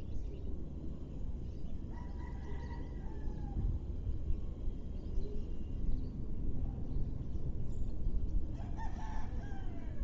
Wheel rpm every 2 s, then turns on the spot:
0, 0, 0, 0, 0.
none